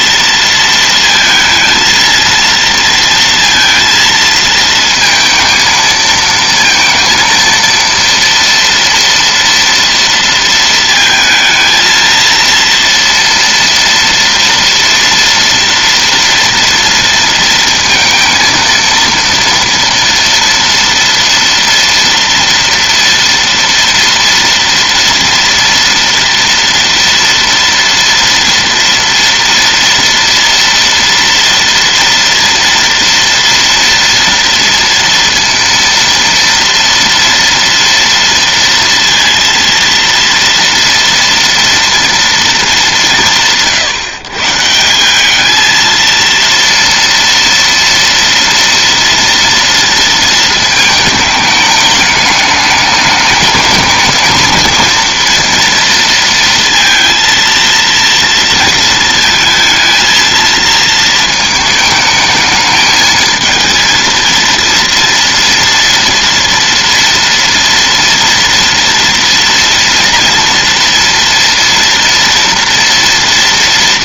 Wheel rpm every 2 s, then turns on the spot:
230, 230, 230, 230, 230, 230, 230, 230, 230, 230, 230, 230, 230, 230, 230, 230, 230, 230, 230, 230, 230, 220, 160, 230, 230, 220, 210, 230, 230, 230, 220, 220, 230, 230, 230, 230, 230.
none